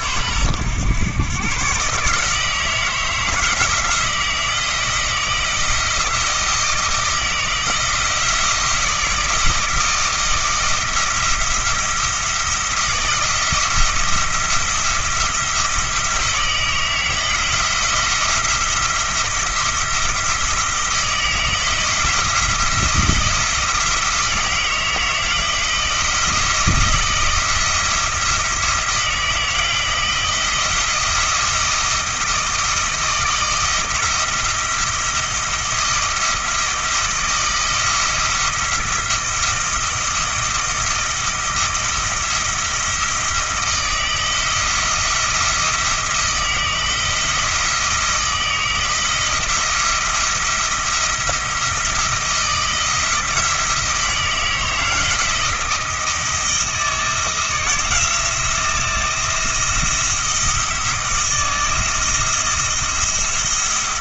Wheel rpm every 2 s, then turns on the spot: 110, 160, 170, 160, 170, 160, 160, 170, 160, 170, 160, 170, 170, 170, 170, 170, 160, 170, 170, 170, 160, 160, 160, 160, 160, 170, 160, 160, 170, 170, 160, 170.
none